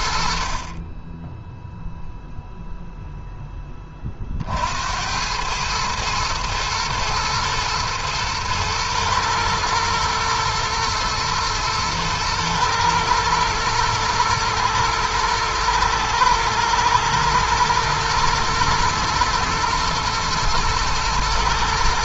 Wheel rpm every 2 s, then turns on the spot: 10, 10, 90, 110, 120, 120, 120, 110, 110, 120, 110.
none